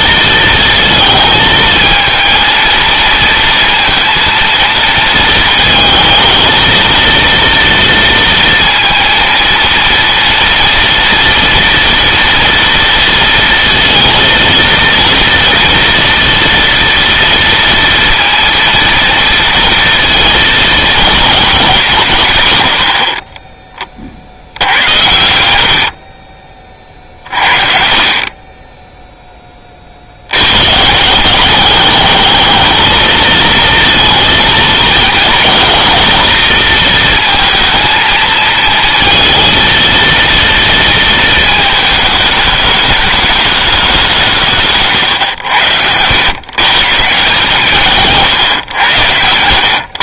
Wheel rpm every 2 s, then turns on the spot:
220, 220, 220, 230, 230, 230, 230, 230, 230, 230, 220, 50, 90, 40, 0, 160, 220, 220, 220, 230, 230, 210, 140, 140, 100.
24-26